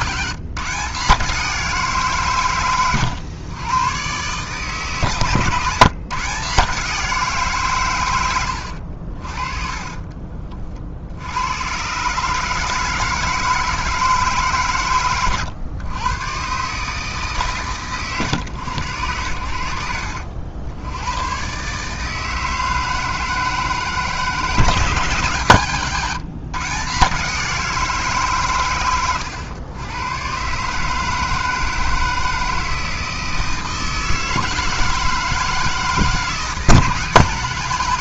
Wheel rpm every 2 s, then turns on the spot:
150, 130, 140, 150, 80, 40, 150, 150, 120, 120, 80, 160, 160, 150, 120, 130, 160, 160, 160.
8-10